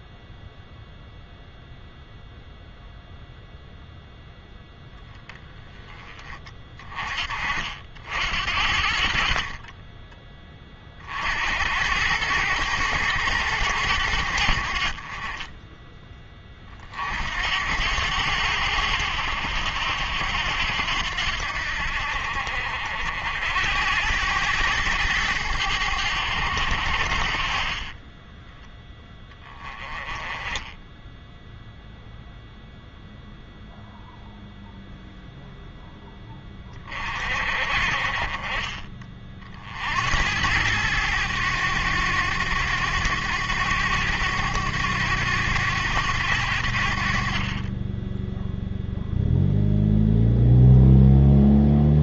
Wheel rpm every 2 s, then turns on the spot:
0, 0, 10, 30, 60, 30, 110, 60, 40, 80, 80, 60, 100, 70, 10, 10, 0, 0, 20, 40, 100, 100, 100, 70, 0, 0.
none